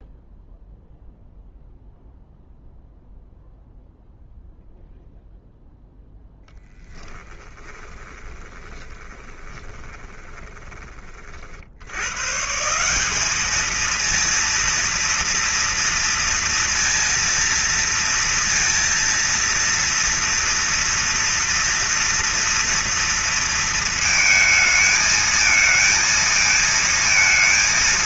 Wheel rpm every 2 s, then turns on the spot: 0, 0, 0, 0, 10, 20, 120, 220, 230, 230, 230, 230, 230, 230.
8-12